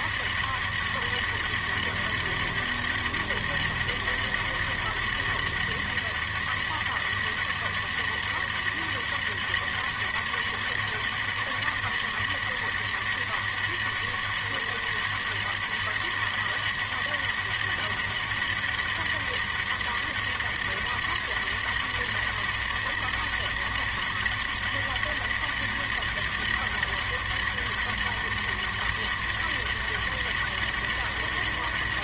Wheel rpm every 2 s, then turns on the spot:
200, 200, 200, 200, 200, 200, 200, 200, 200, 200, 200, 200, 200, 200, 200, 200.
none